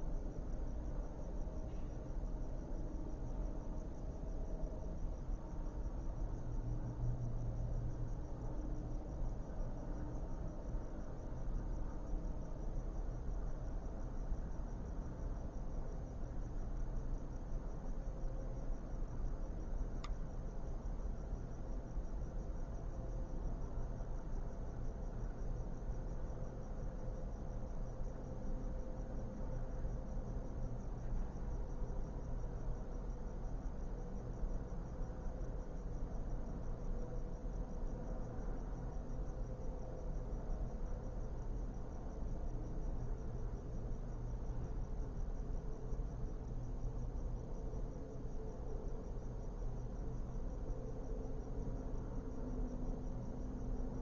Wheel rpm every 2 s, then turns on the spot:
0, 0, 0, 0, 0, 0, 0, 0, 0, 0, 0, 0, 0, 0, 0, 0, 0, 0, 0, 0, 0, 0, 0, 0, 0, 0, 0.
none